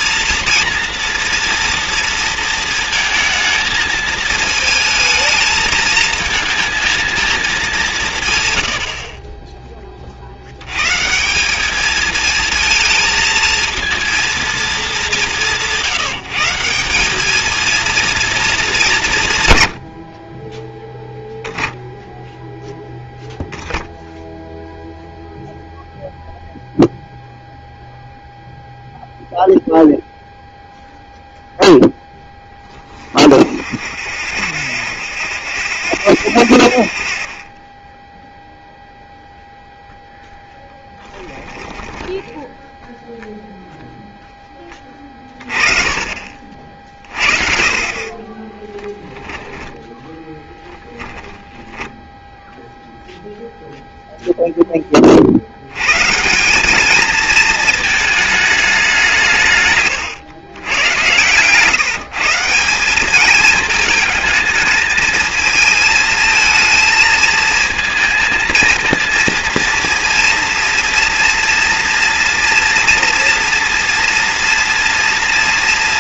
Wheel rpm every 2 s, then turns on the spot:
230, 230, 220, 220, 90, 90, 220, 220, 170, 210, 20, 0, 0, 0, 0, 0, 10, 70, 80, 0, 0, 0, 10, 40, 10, 10, 0, 10, 190, 210, 110, 180, 220, 220, 220, 230, 230, 230.
48-52